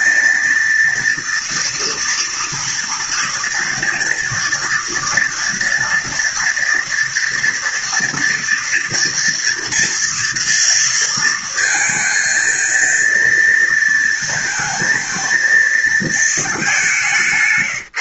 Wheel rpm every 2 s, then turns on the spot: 230, 230, 230, 230, 230, 230, 230, 230, 200.
none